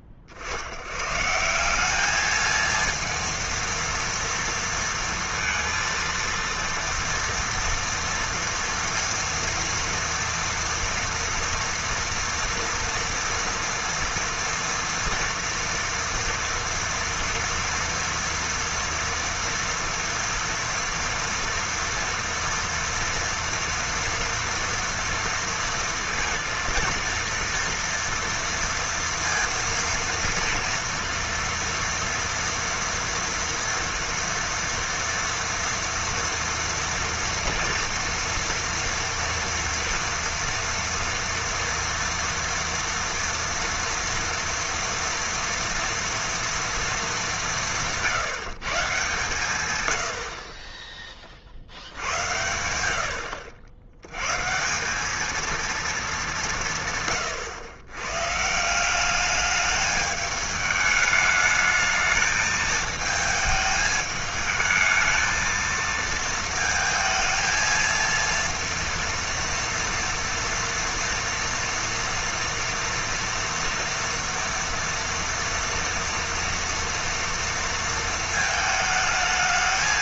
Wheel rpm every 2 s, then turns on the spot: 50, 220, 230, 230, 230, 230, 230, 230, 230, 230, 240, 230, 230, 230, 230, 230, 230, 230, 230, 230, 230, 230, 230, 230, 140, 30, 90, 160, 160, 170, 210, 220, 220, 220, 230, 240, 230, 230, 230, 220.
none